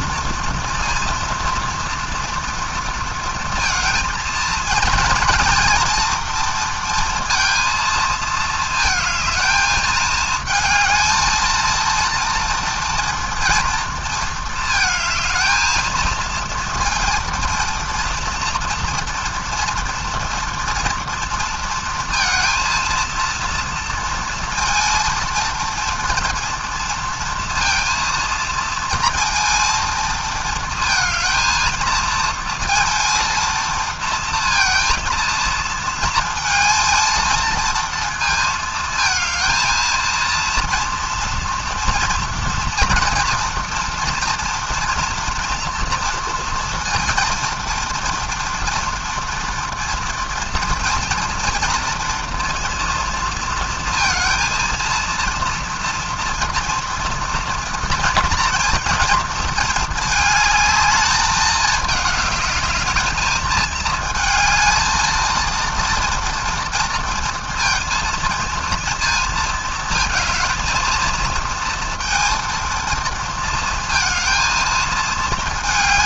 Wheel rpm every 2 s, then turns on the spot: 230, 230, 230, 230, 230, 220, 230, 220, 230, 230, 230, 230, 230, 230, 230, 220, 230, 230, 230, 220, 230, 230, 240, 230, 230, 230, 230, 230, 240, 230, 220, 210, 220, 230, 230, 230, 230, 220.
none